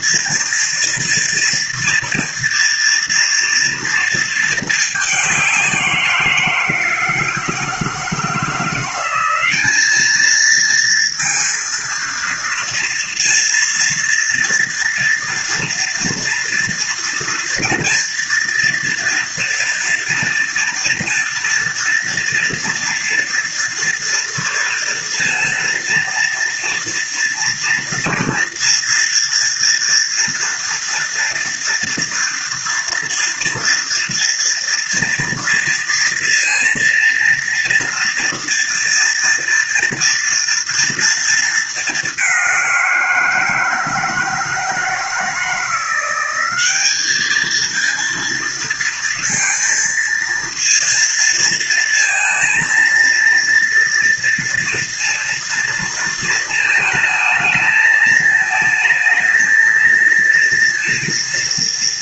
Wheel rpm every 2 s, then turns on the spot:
230, 230, 220, 170, 170, 220, 230, 230, 230, 230, 230, 230, 230, 230, 240, 240, 230, 230, 230, 230, 230, 200, 160, 190, 230, 230, 230, 230, 230, 220, 230.
none